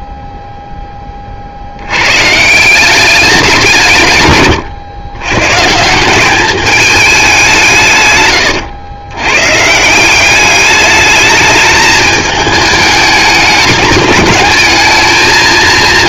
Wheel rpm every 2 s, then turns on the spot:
10, 180, 120, 210, 110, 210, 210, 210.
none